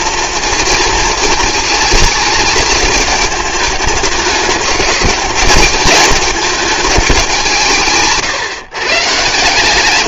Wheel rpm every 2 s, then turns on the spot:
230, 220, 210, 220, 140.
none